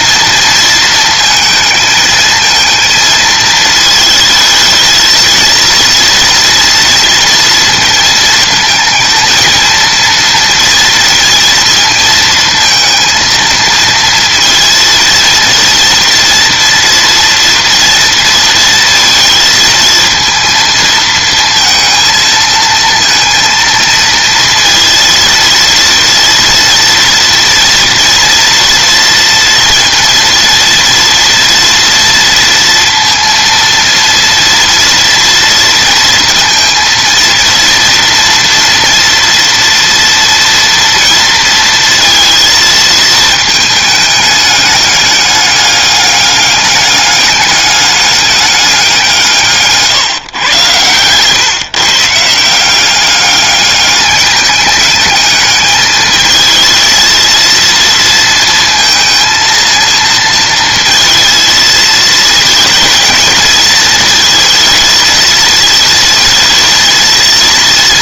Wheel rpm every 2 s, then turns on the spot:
220, 220, 220, 230, 220, 230, 230, 230, 230, 230, 230, 230, 230, 230, 230, 230, 230, 230, 230, 230, 230, 220, 200, 200, 190, 120, 190, 210, 230, 230, 230, 230, 220, 230.
none